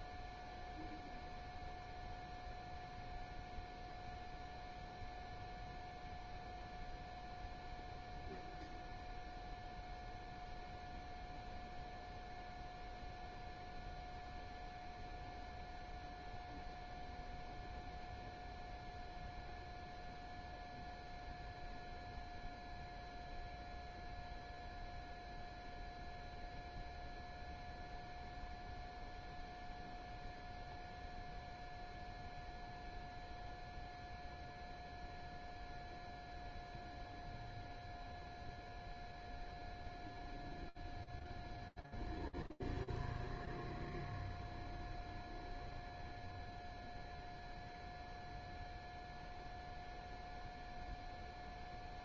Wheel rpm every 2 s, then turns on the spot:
0, 0, 0, 0, 0, 0, 0, 0, 0, 0, 0, 0, 0, 0, 0, 0, 0, 0, 0, 0, 0, 0, 0, 0, 0, 0.
none